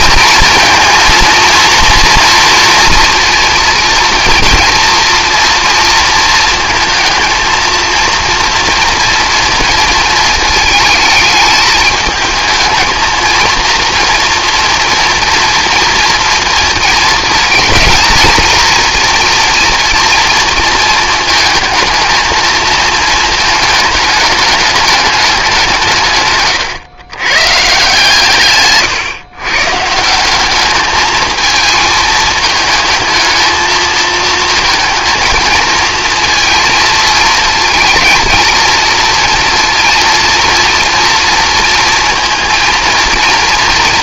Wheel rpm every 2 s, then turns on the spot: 230, 230, 230, 230, 230, 220, 230, 230, 230, 230, 230, 220, 210, 120, 120, 200, 220, 220, 230, 230, 230, 230.
28-30